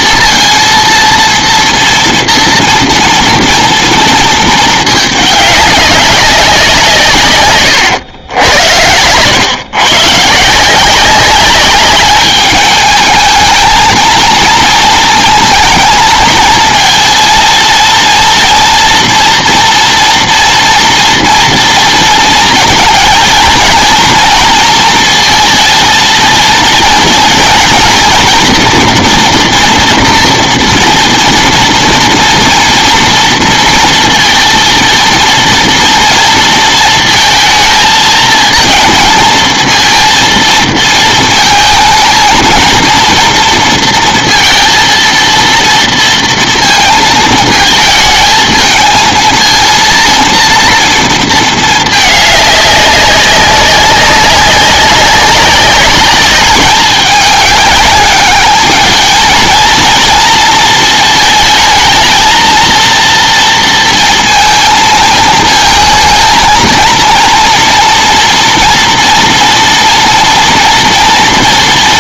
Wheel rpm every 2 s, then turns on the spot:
230, 230, 220, 180, 90, 160, 210, 220, 220, 230, 230, 230, 230, 230, 240, 230, 230, 230, 230, 230, 230, 230, 230, 230, 220, 240, 210, 190, 200, 210, 230, 230, 230, 230, 230, 230.
none